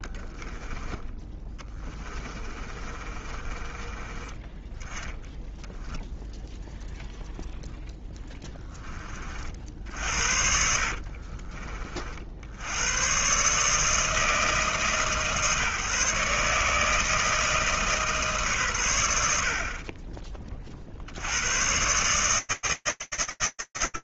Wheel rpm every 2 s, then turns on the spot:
20, 30, 10, 0, 30, 40, 120, 140, 160, 90, 70, 140.
0-4 10-12